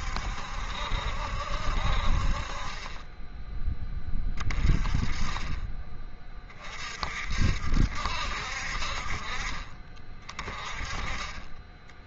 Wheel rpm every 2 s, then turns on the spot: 70, 30, 20, 40, 50, 20.
none